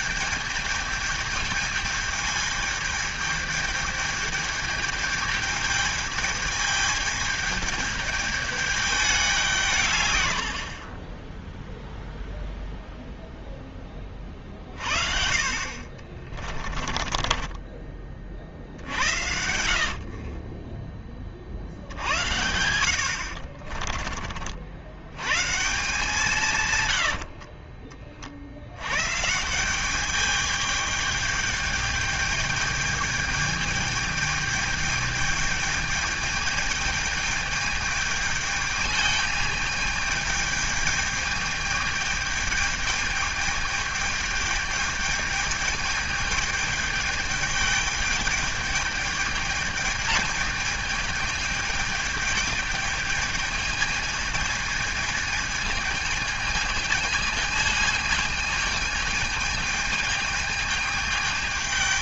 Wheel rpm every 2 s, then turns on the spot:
210, 210, 220, 210, 210, 60, 0, 40, 20, 50, 30, 80, 60, 130, 80, 210, 210, 210, 210, 210, 210, 210, 210, 210, 210, 220, 220, 220, 220, 220, 220.
16-18 22-24 26-28